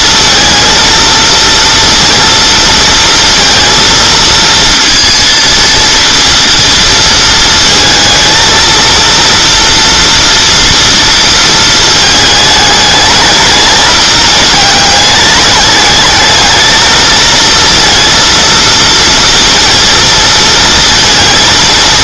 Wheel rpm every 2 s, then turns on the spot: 230, 230, 230, 230, 230, 230, 220, 220, 220, 230, 230.
none